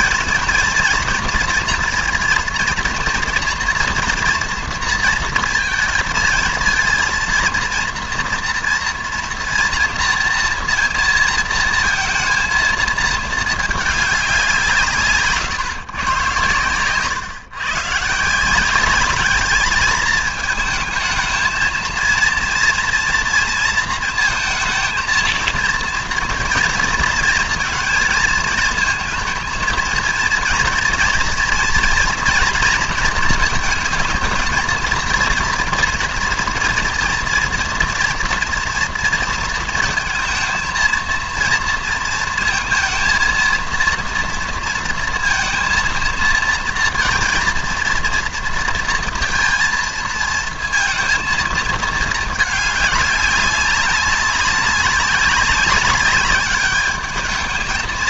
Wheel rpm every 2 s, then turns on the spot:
230, 230, 230, 230, 230, 230, 230, 180, 120, 180, 220, 230, 230, 230, 230, 240, 230, 220, 230, 230, 230, 230, 230, 230, 230, 230, 210, 190, 210.
none